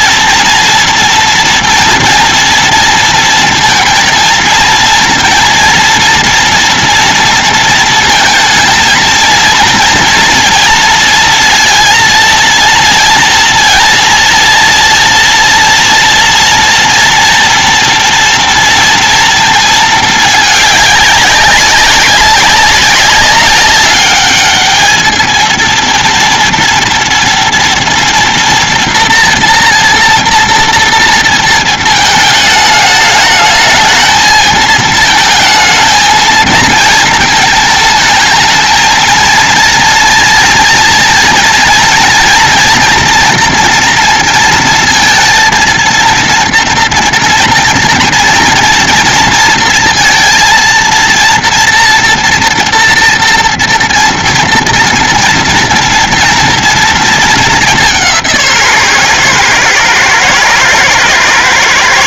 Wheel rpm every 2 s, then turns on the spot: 230, 230, 230, 240, 230, 230, 230, 230, 230, 240, 220, 200, 200, 230, 230, 230, 220, 220, 220, 220, 230, 240, 230, 230, 230, 230, 230, 230, 230, 170, 110.
none